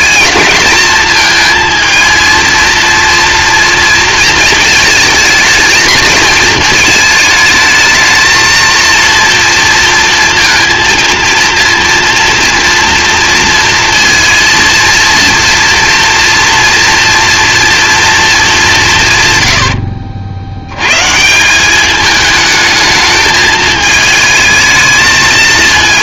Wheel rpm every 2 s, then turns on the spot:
220, 230, 230, 220, 230, 230, 230, 230, 230, 190, 100, 220, 220.
none